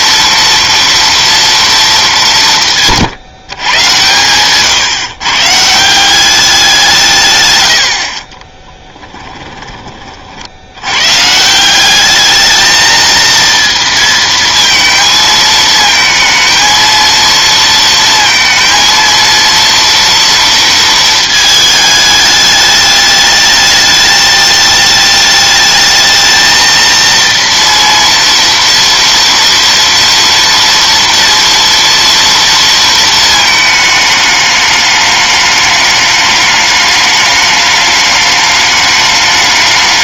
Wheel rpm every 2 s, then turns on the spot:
230, 170, 120, 190, 20, 80, 220, 220, 230, 230, 230, 210, 210, 230, 230, 230, 230, 210, 210, 210.
8-10